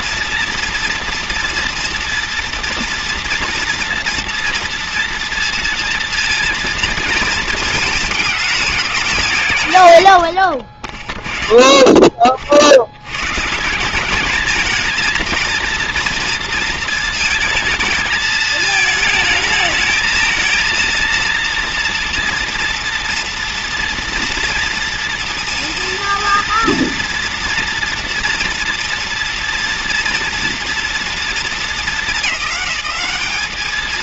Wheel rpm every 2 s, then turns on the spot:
230, 230, 230, 220, 210, 60, 50, 210, 230, 220, 220, 230, 240, 230, 230, 230, 210.
none